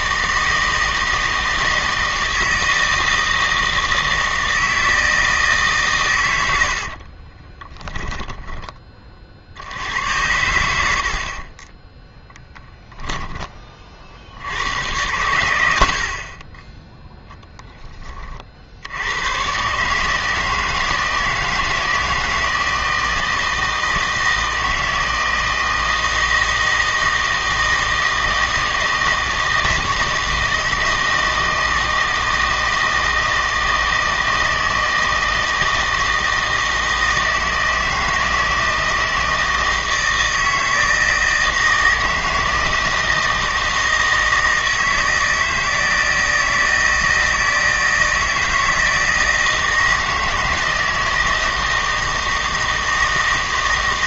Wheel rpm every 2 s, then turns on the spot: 160, 160, 160, 80, 10, 90, 10, 90, 20, 50, 160, 160, 160, 160, 160, 160, 160, 160, 160, 160, 160, 160, 160, 160, 160, 160, 160.
6-10 12-14